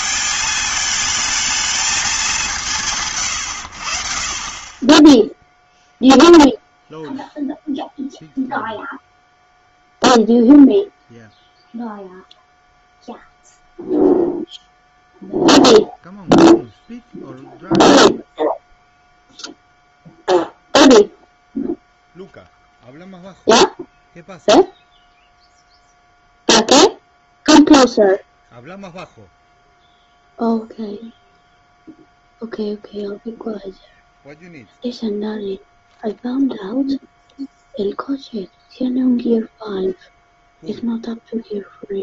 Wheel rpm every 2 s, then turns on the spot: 220, 150, 20, 0, 0, 0, 0, 0, 0, 0, 0, 0, 0, 0, 0, 0, 0, 0, 0, 0, 0.
none